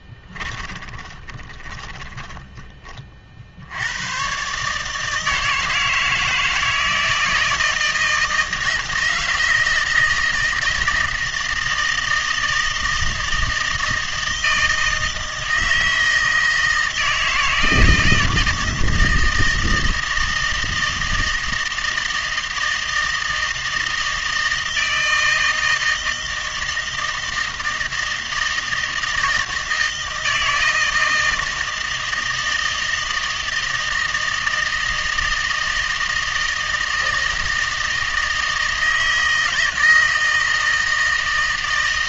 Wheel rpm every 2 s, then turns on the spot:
20, 30, 140, 160, 160, 160, 160, 160, 160, 160, 160, 160, 160, 160, 160, 160, 160, 160, 160, 160, 160.
0-2